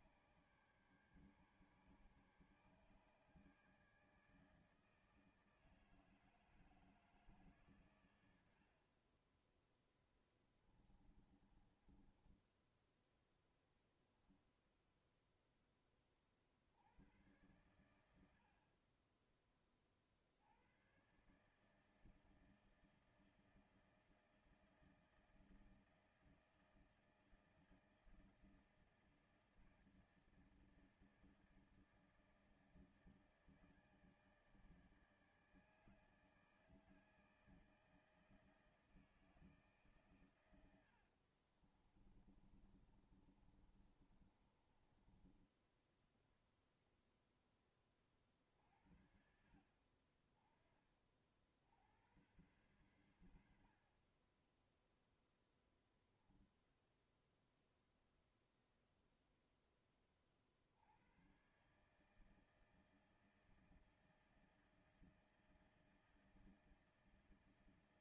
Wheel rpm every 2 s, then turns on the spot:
140, 140, 150, 160, 90, 10, 10, 0, 40, 70, 70, 160, 160, 160, 160, 160, 160, 160, 160, 160, 120, 30, 30, 10, 40, 30, 100, 20, 10, 0, 40, 160, 160, 160.
10-14 40-46 56-58